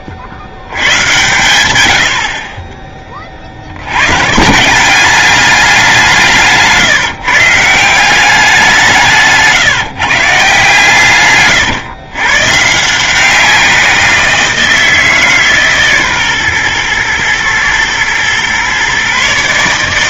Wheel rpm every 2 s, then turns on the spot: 90, 30, 180, 160, 180, 150, 150, 160, 120, 130.
none